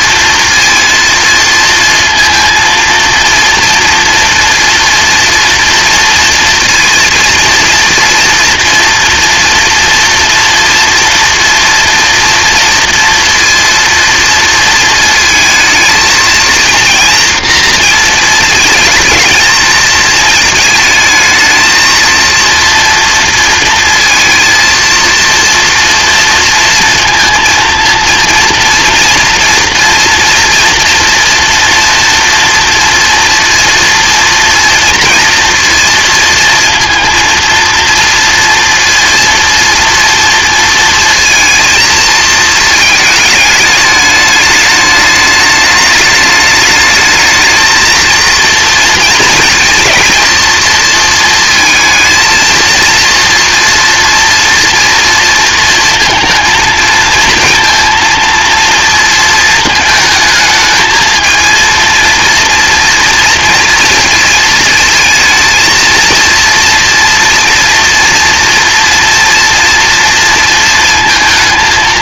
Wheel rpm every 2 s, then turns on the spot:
230, 230, 240, 230, 230, 230, 230, 230, 230, 230, 220, 230, 230, 230, 240, 240, 230, 230, 220, 230, 230, 220, 210, 210, 230, 230, 230, 230, 230, 230, 220, 230, 230, 240, 230, 230.
none